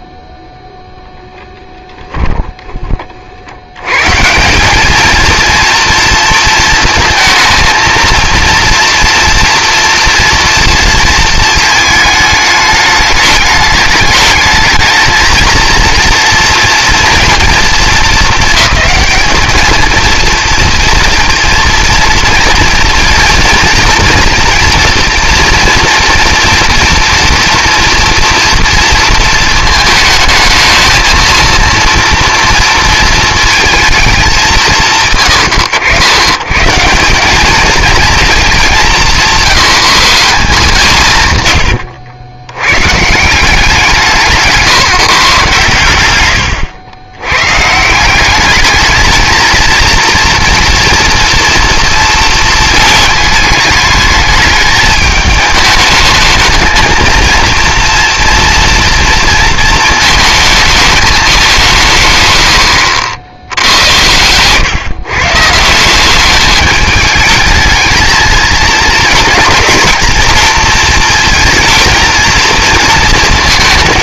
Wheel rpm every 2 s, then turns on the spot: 0, 40, 220, 220, 230, 230, 210, 220, 230, 220, 240, 230, 230, 230, 230, 230, 230, 140, 180, 170, 150, 160, 140, 120, 220, 230, 220, 210, 230, 230, 200, 70, 140, 210, 220, 230, 230.
none